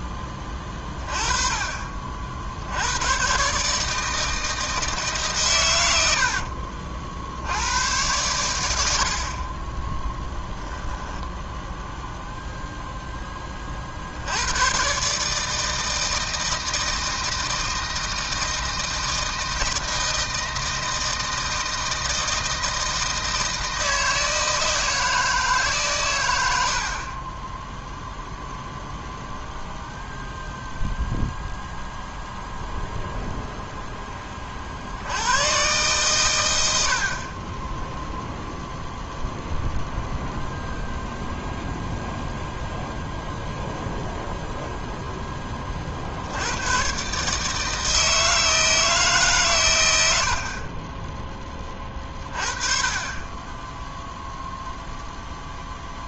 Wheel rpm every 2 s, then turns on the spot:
20, 100, 160, 50, 80, 0, 0, 100, 160, 160, 160, 160, 160, 70, 0, 0, 0, 40, 110, 0, 0, 0, 0, 110, 160, 40, 30, 0.
none